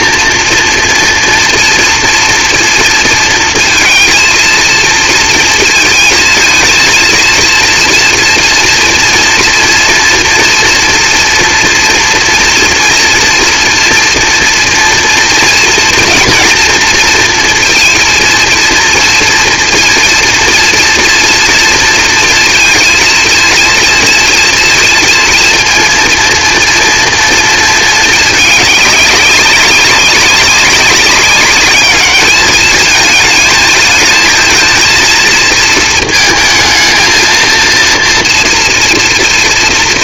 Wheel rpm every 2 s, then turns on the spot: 230, 230, 230, 220, 230, 230, 230, 230, 230, 230, 230, 230, 230, 230, 210, 200, 210, 220, 220, 230.
none